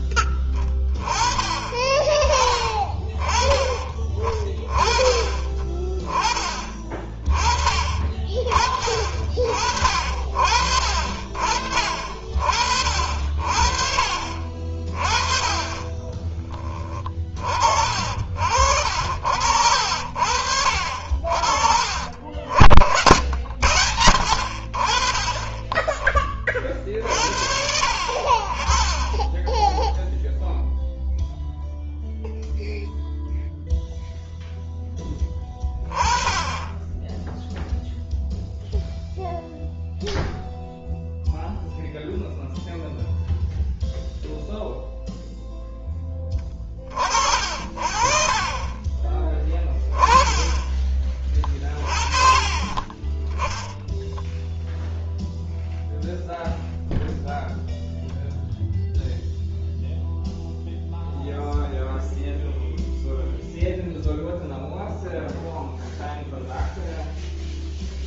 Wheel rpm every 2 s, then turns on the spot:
20, 30, 20, 20, 40, 50, 50, 40, 20, 50, 60, 70, 80, 30, 40, 0, 0, 0, 20, 0, 0, 0, 0, 20, 30, 10, 30, 0, 0, 0, 0, 0, 0, 0.
16-18 48-50